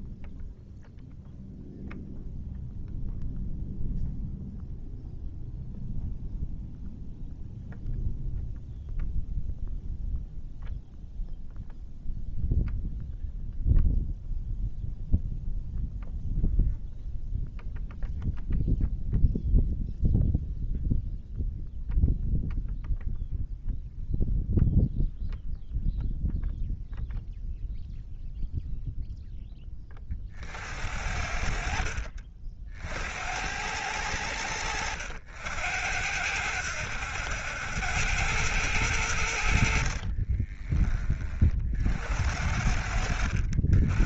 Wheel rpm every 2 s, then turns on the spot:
0, 0, 0, 0, 0, 0, 0, 0, 0, 0, 0, 0, 0, 0, 0, 60, 70, 90, 120, 100, 30, 80.
none